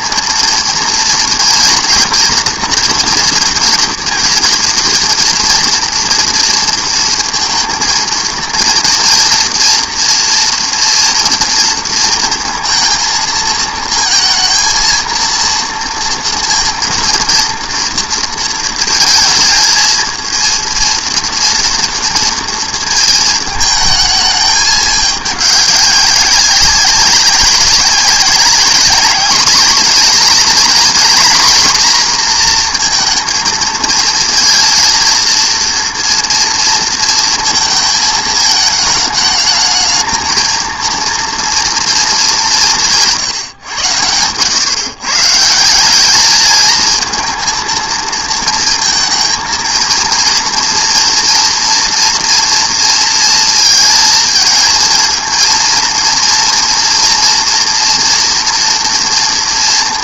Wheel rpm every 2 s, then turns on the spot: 230, 230, 230, 230, 230, 230, 230, 230, 230, 230, 230, 230, 210, 200, 200, 230, 230, 230, 230, 220, 230, 190, 120, 220, 230, 230, 230, 230, 230, 240.
none